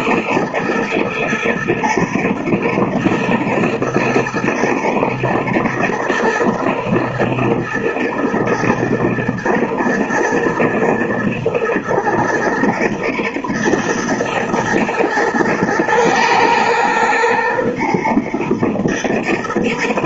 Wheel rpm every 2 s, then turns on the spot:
110, 110, 110, 120, 110, 110, 110, 110, 110, 120.
none